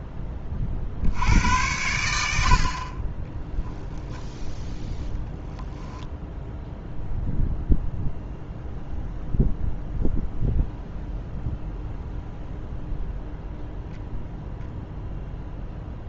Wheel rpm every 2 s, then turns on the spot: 60, 50, 0, 0, 0, 0, 0, 0.
none